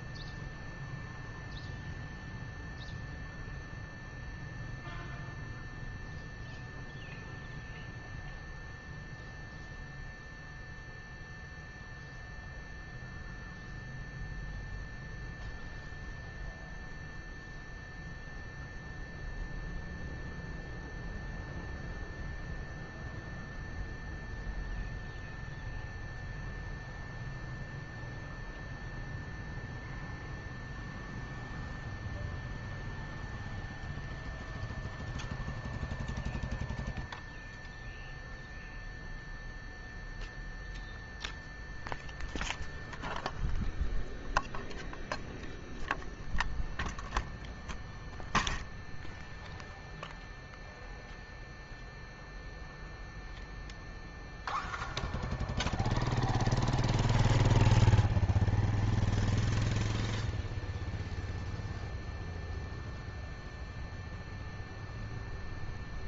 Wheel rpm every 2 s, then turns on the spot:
0, 0, 0, 0, 0, 0, 0, 0, 0, 0, 0, 0, 0, 0, 0, 0, 0, 0, 0, 0, 0, 0, 0, 0, 0, 0, 0, 0, 0, 0, 0, 0, 0.
none